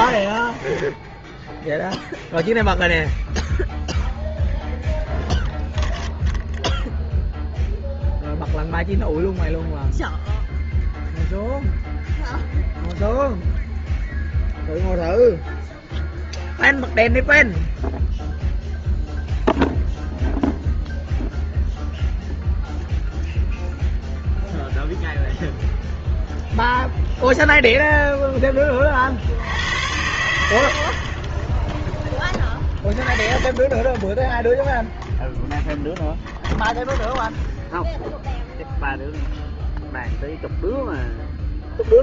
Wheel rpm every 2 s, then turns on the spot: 0, 0, 0, 0, 0, 0, 0, 0, 0, 0, 0, 0, 0, 0, 10, 80, 20, 0, 0, 0, 0.
none